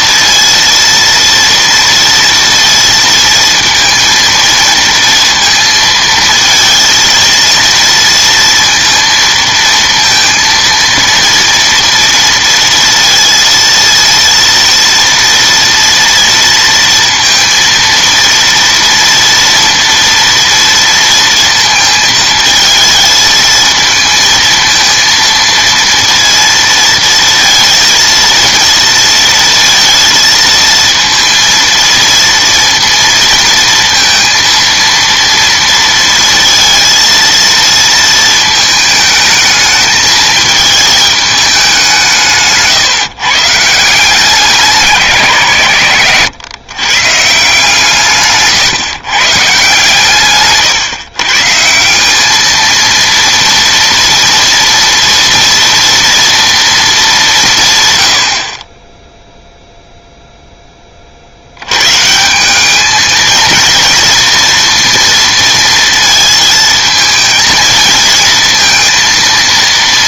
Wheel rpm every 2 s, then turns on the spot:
230, 230, 230, 220, 230, 230, 230, 230, 230, 230, 230, 220, 230, 230, 230, 230, 230, 230, 230, 220, 220, 150, 180, 130, 140, 130, 220, 230, 230, 40, 10, 200, 230, 230, 230.
none